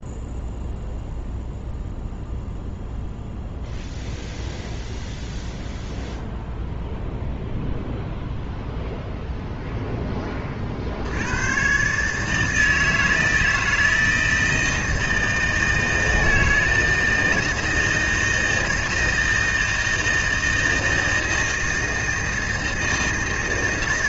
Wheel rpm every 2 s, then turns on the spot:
0, 0, 0, 0, 0, 50, 160, 160, 160, 160, 160, 160.
none